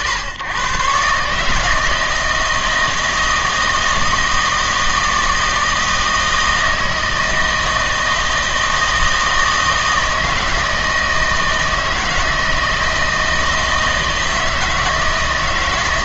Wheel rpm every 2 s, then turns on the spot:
130, 160, 160, 160, 160, 160, 160, 160.
none